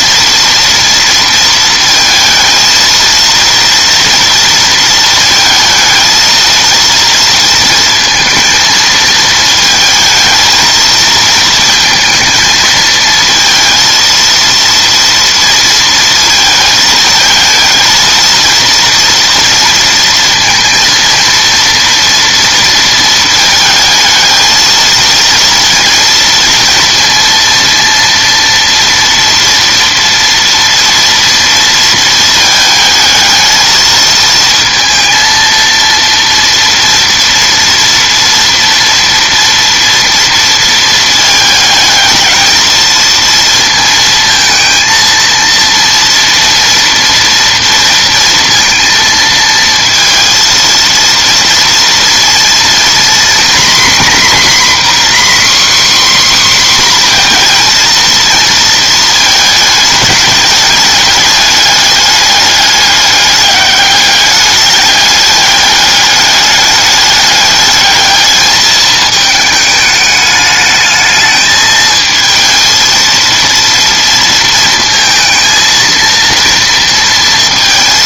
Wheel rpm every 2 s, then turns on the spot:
230, 230, 230, 230, 220, 220, 220, 230, 220, 230, 230, 230, 220, 230, 230, 230, 220, 230, 230, 230, 230, 220, 230, 230, 230, 230, 240, 260, 260, 230, 210, 200, 210, 210, 210, 210, 230, 230, 230.
none